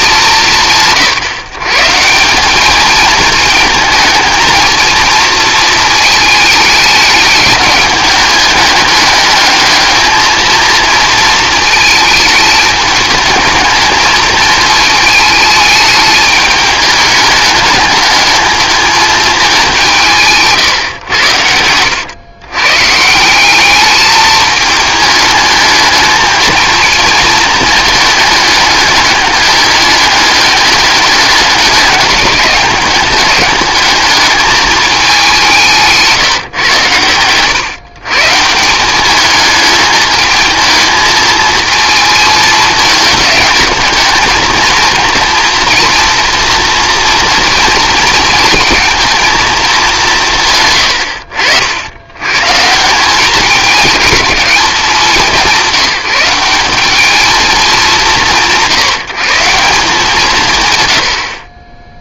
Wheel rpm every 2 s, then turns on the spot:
160, 210, 220, 210, 200, 220, 220, 220, 210, 220, 140, 140, 210, 220, 210, 210, 210, 210, 120, 180, 220, 210, 230, 230, 230, 100, 160, 170, 190, 170, 110.
20-22